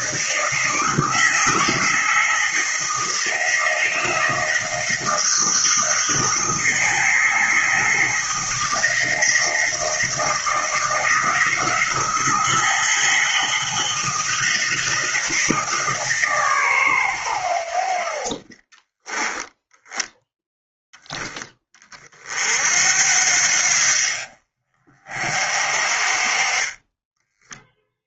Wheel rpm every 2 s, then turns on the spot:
160, 160, 160, 160, 160, 160, 160, 160, 110, 20, 10, 70, 40, 10.
none